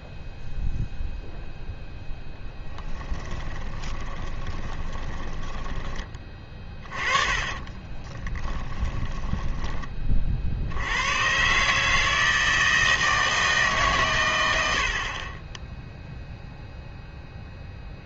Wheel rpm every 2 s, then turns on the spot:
0, 10, 20, 30, 20, 80, 160, 80, 0.
2-10